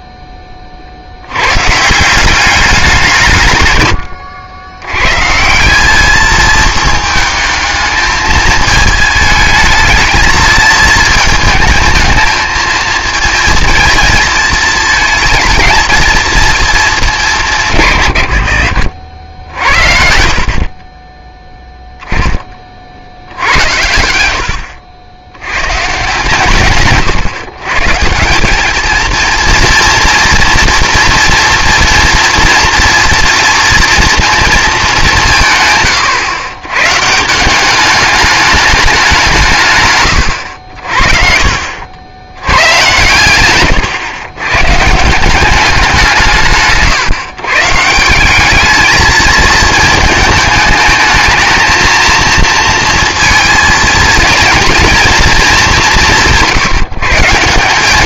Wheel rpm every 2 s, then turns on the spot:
30, 190, 100, 220, 220, 220, 220, 220, 220, 80, 40, 50, 70, 110, 200, 240, 240, 230, 120, 210, 80, 110, 150, 150, 210, 220, 230, 230, 160.
24-26 40-42